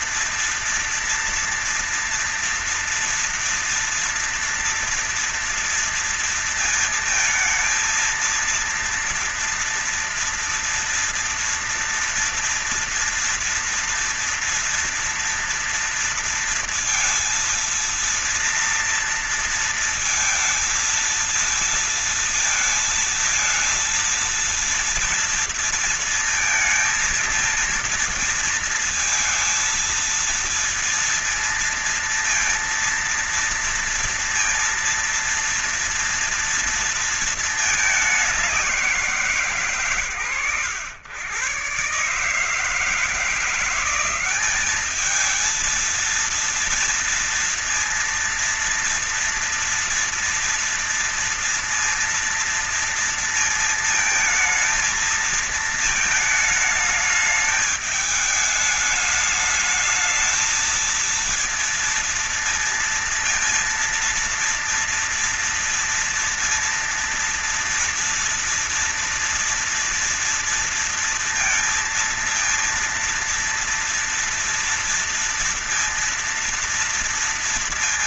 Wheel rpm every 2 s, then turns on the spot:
230, 230, 230, 230, 230, 230, 230, 230, 230, 230, 230, 220, 230, 230, 230, 230, 230, 230, 230, 200, 100, 150, 190, 230, 230, 230, 230, 220, 220, 210, 220, 230, 230, 230, 230, 230, 230, 230, 230.
none